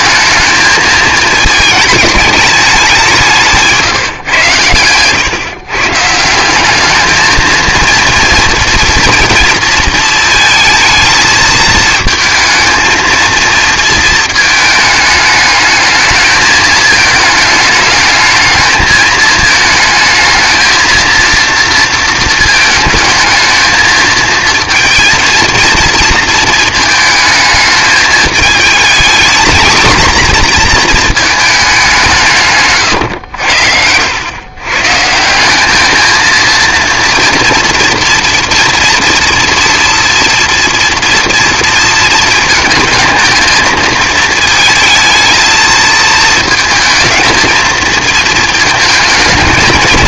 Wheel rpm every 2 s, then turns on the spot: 220, 190, 120, 210, 230, 220, 230, 220, 220, 220, 230, 220, 230, 220, 230, 230, 110, 140, 230, 240, 230, 220, 230, 220, 220.
none